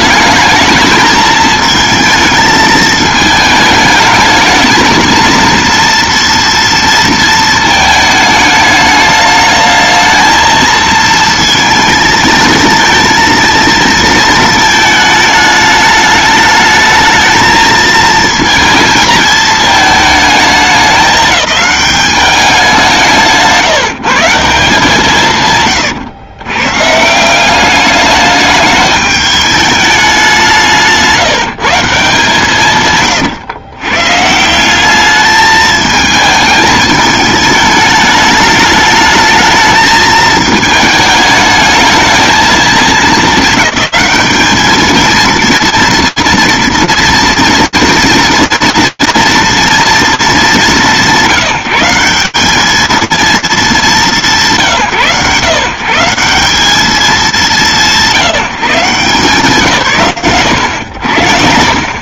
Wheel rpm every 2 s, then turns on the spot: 210, 220, 220, 230, 210, 220, 220, 220, 210, 220, 210, 190, 160, 110, 210, 190, 160, 160, 220, 210, 220, 220, 220, 230, 230, 170, 220, 130, 170, 130, 100.
none